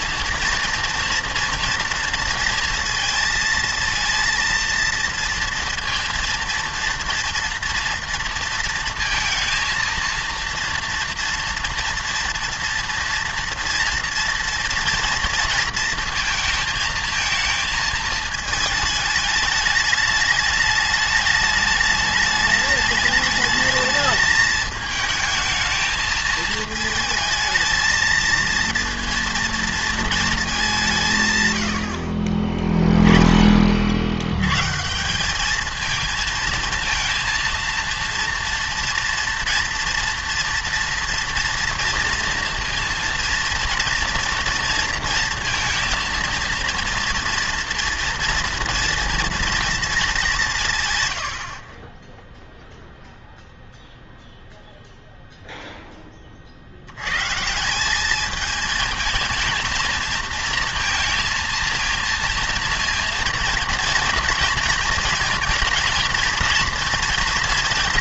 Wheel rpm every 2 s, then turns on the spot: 230, 230, 230, 230, 230, 230, 230, 230, 230, 220, 210, 210, 220, 220, 220, 200, 20, 130, 230, 230, 230, 230, 230, 230, 230, 150, 0, 0, 70, 220, 220, 230, 230, 230.
none